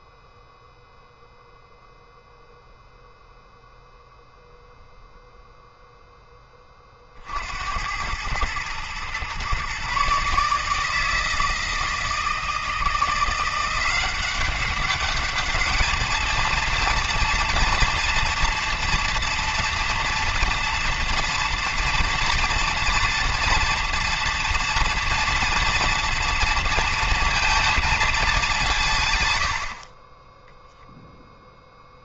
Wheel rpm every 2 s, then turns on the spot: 0, 0, 0, 30, 120, 160, 170, 200, 230, 230, 230, 230, 230, 230, 160, 0.
none